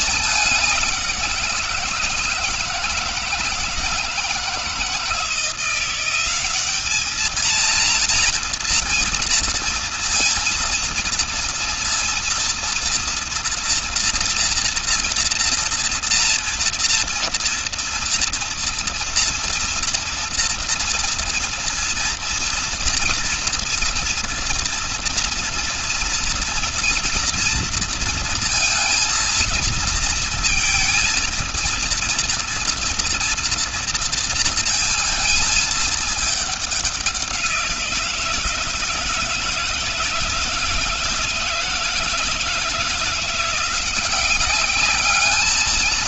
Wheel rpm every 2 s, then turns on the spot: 200, 160, 160, 200, 230, 230, 230, 240, 230, 230, 230, 230, 230, 240, 230, 220, 230, 230, 200, 160, 170, 170, 200.
none